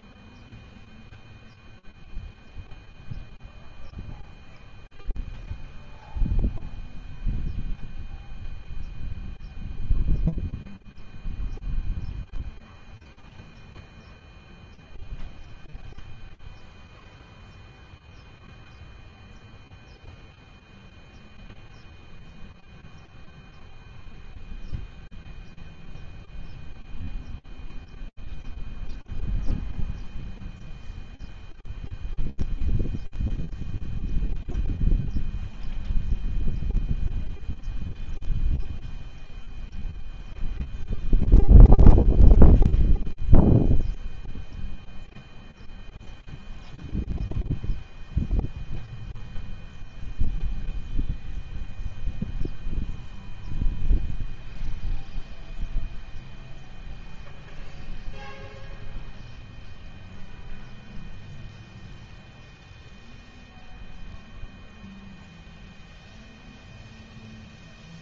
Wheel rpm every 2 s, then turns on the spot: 0, 0, 0, 0, 0, 0, 0, 0, 0, 0, 0, 0, 0, 0, 0, 0, 0, 0, 0, 0, 0, 0, 0, 0, 0, 0, 0, 0, 0, 0, 0, 0, 0, 0.
none